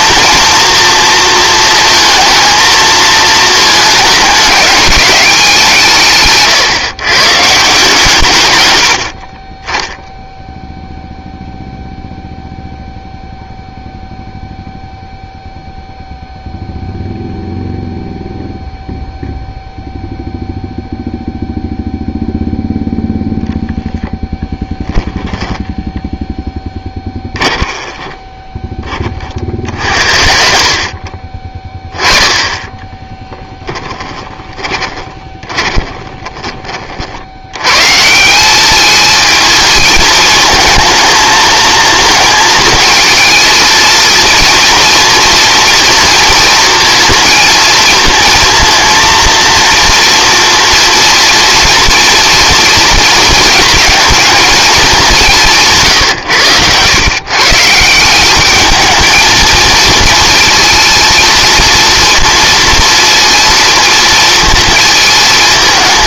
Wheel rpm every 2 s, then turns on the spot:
240, 220, 200, 140, 100, 0, 0, 0, 0, 0, 0, 0, 10, 10, 10, 40, 10, 20, 40, 210, 220, 230, 230, 230, 230, 230, 230, 220, 120, 210, 230, 230, 220.
32-36